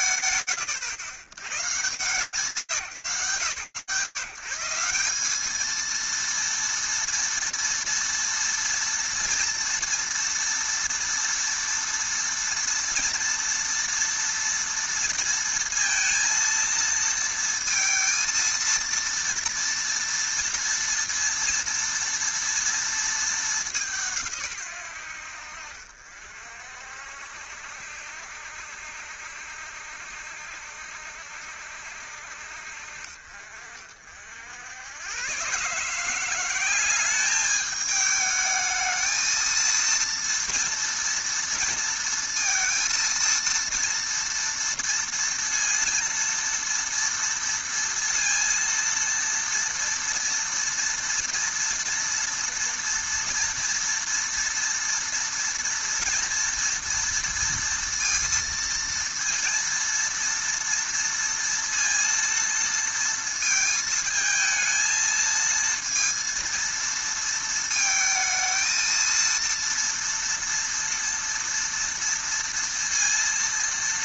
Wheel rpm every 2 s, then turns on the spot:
130, 110, 180, 230, 230, 230, 230, 230, 230, 230, 230, 220, 80, 60, 70, 70, 50, 150, 210, 230, 230, 230, 230, 230, 230, 230, 230, 230, 230, 230, 230, 220, 230, 220, 230, 230, 230.
none